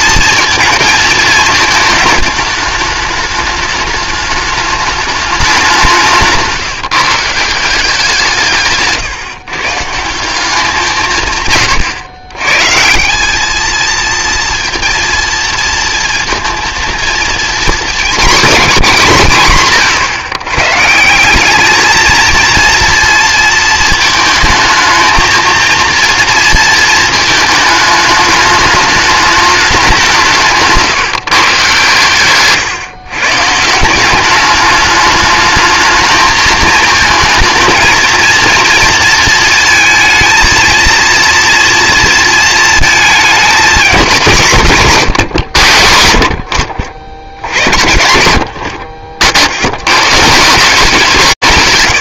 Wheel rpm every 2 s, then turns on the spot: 230, 210, 210, 160, 160, 180, 130, 230, 230, 220, 130, 230, 220, 230, 210, 160, 140, 200, 220, 230, 220, 230, 170, 90, 90, 120.
none